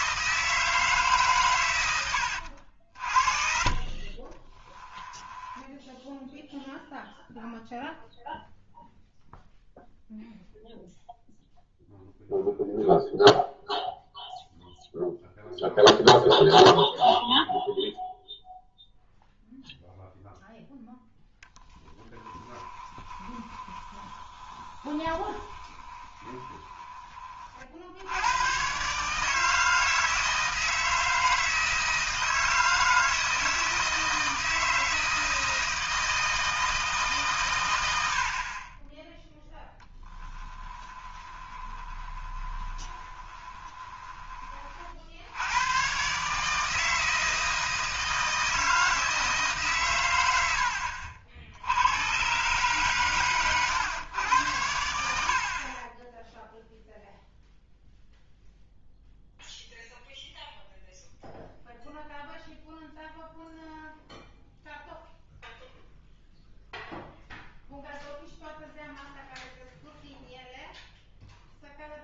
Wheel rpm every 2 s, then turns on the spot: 160, 60, 20, 0, 0, 0, 0, 0, 0, 0, 10, 20, 20, 20, 120, 160, 160, 160, 160, 30, 10, 20, 40, 160, 160, 80, 130, 90, 0, 0, 0, 0, 0, 0, 0, 0.
4-6 22-28 40-44